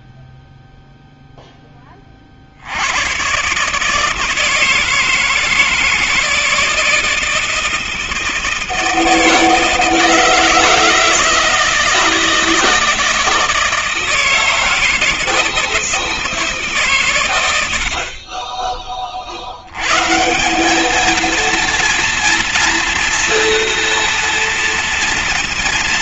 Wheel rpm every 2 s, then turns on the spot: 10, 140, 160, 160, 160, 160, 160, 160, 90, 80, 230, 230, 230.
none